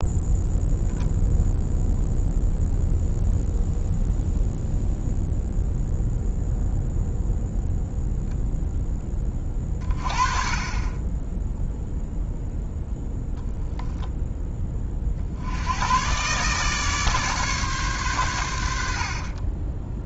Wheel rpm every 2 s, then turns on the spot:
0, 0, 0, 0, 10, 20, 0, 30, 150, 70.
18-20